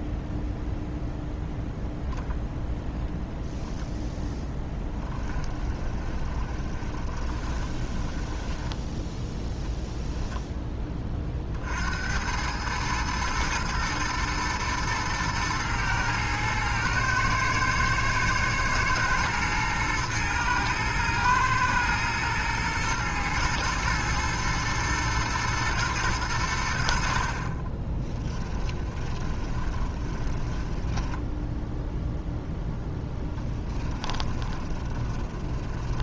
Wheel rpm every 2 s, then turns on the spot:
0, 0, 10, 20, 10, 10, 110, 110, 110, 110, 120, 110, 110, 90, 20, 10, 0, 20.
4-10 28-32 34-36